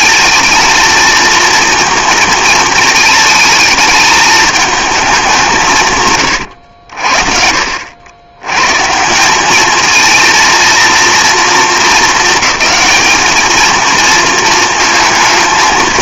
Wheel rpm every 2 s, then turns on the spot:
220, 230, 220, 90, 120, 230, 220, 220.
none